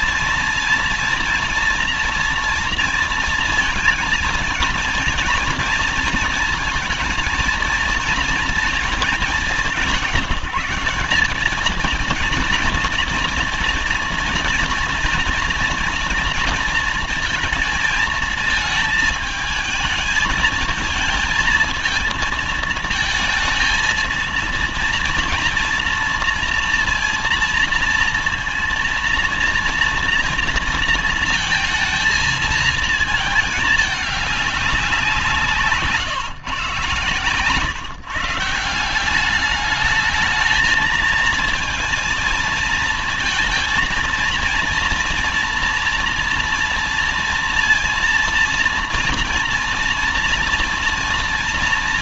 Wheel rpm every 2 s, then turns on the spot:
230, 230, 230, 230, 230, 190, 230, 230, 230, 220, 220, 230, 230, 230, 230, 230, 220, 190, 130, 160, 220, 230, 230, 230, 230, 230.
none